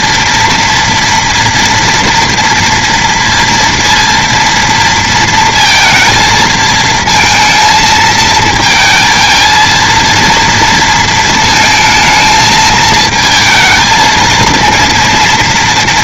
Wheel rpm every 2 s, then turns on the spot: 230, 230, 230, 220, 220, 230, 220, 230.
none